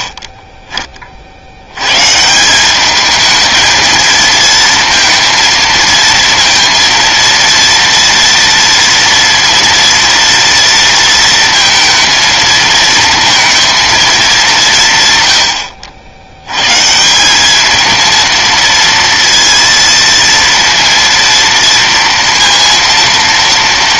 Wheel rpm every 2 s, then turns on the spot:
50, 210, 230, 230, 230, 230, 230, 150, 170, 230, 230, 230.
none